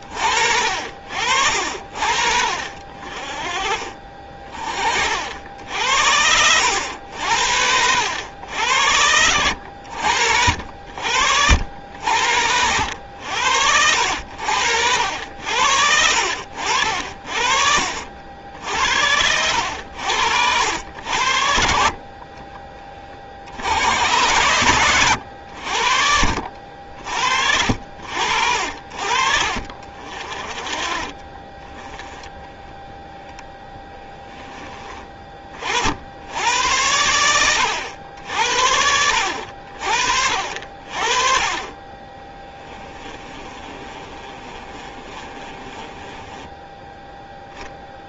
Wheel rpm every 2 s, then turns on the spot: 60, 50, 40, 90, 80, 70, 80, 70, 60, 70, 80, 20, 100, 70, 70, 40, 20, 20, 90, 60, 50, 20, 30, 10.
16-18 22-24 26-28 42-46